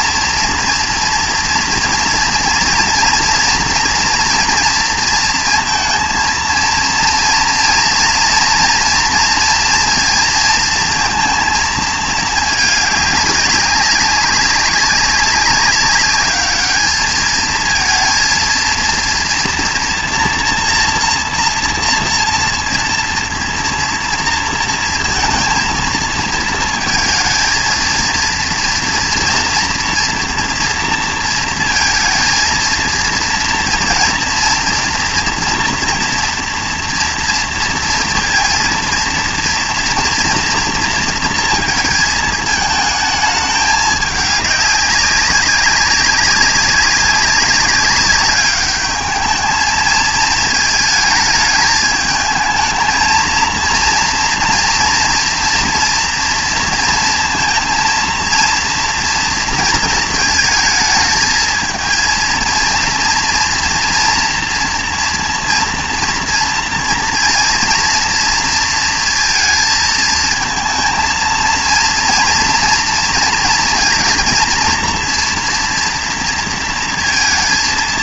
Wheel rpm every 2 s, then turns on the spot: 240, 230, 230, 230, 230, 230, 220, 190, 210, 230, 240, 230, 230, 230, 230, 240, 230, 230, 230, 230, 230, 220, 200, 200, 200, 220, 220, 230, 230, 230, 220, 230, 230, 230, 230, 230, 240, 230, 230.
none